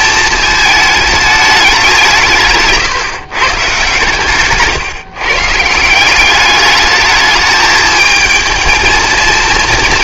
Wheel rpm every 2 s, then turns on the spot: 220, 150, 140, 210, 230.
none